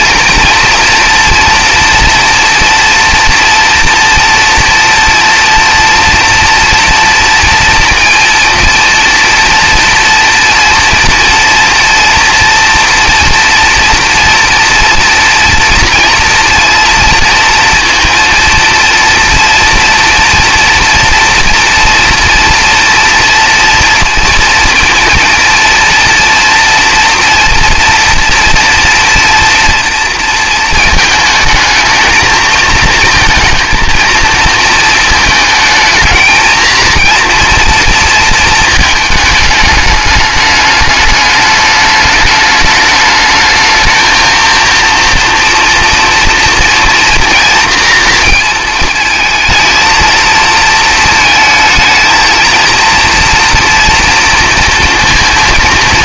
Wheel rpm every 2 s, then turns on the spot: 240, 230, 240, 230, 230, 230, 230, 230, 230, 230, 230, 230, 230, 230, 230, 220, 220, 220, 230, 220, 210, 210, 230, 230, 230, 220, 230, 230.
none